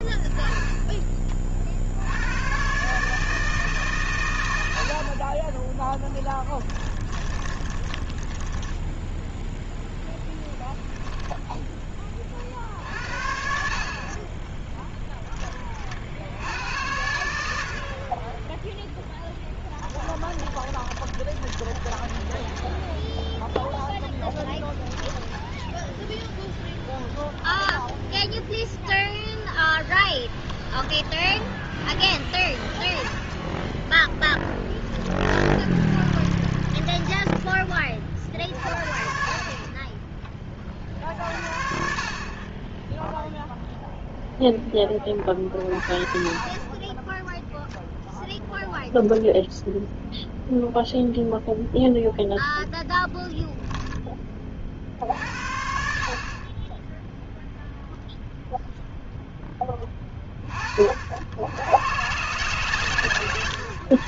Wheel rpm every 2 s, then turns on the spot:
10, 120, 90, 10, 10, 10, 50, 10, 80, 10, 20, 10, 10, 0, 0, 20, 10, 10, 30, 60, 30, 20, 20, 20, 0, 0, 10, 40, 10, 0, 40, 140.
6-12 14-16 20-22 24-26 30-32 34-38